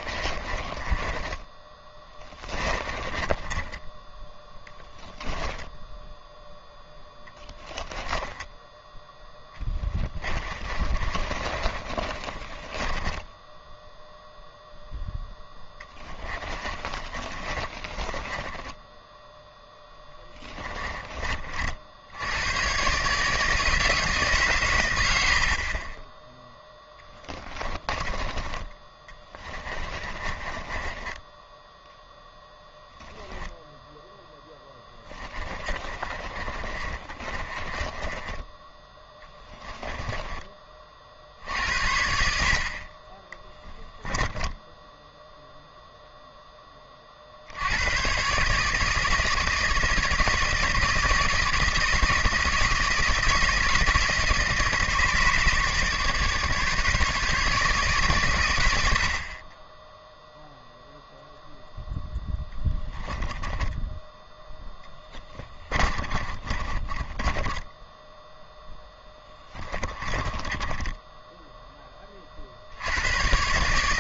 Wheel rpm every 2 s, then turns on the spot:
20, 20, 10, 0, 10, 30, 40, 0, 30, 20, 10, 110, 130, 10, 20, 20, 0, 10, 30, 10, 30, 50, 10, 20, 150, 160, 160, 160, 150, 90, 0, 10, 10, 30, 0, 10, 60.
0-4 10-14 16-22 30-32 34-38 62-68 70-72